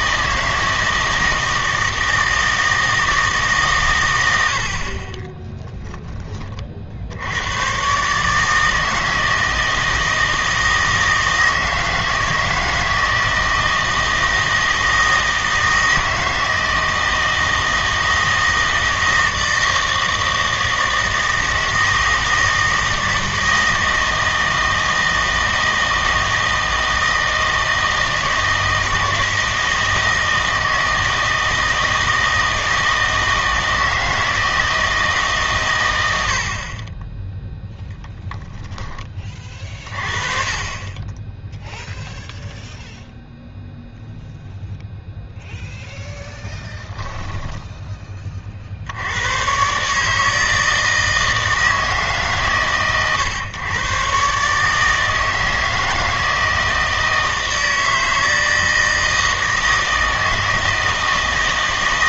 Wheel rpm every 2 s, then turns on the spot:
160, 160, 70, 40, 160, 160, 160, 160, 160, 160, 160, 160, 160, 160, 160, 160, 160, 160, 40, 10, 20, 0, 0, 0, 60, 160, 130, 150, 160, 160, 160.
none